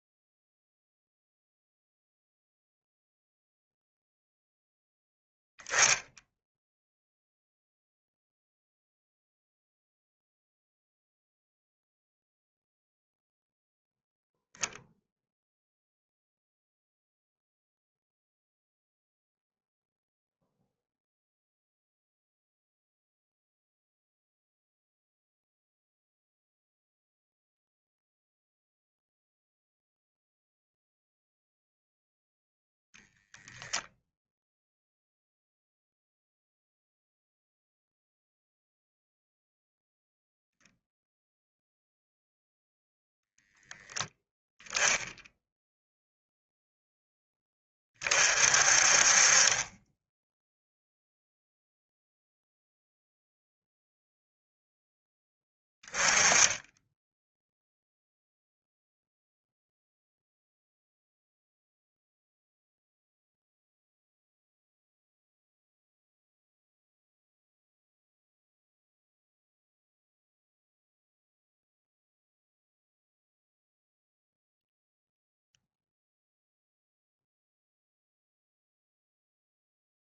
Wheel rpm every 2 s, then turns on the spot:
0, 0, 0, 0, 0, 0, 0, 0, 0, 0, 0, 0, 0, 0, 0, 0, 0, 0, 0, 0, 0, 0, 0, 0, 50, 0, 0, 0, 10, 0, 0, 0, 0, 0, 0, 0, 0, 0, 0, 0.
none